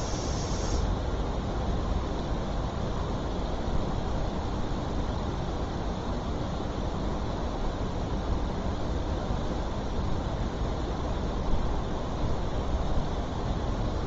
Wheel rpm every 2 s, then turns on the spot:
0, 0, 0, 0, 0, 0, 0.
none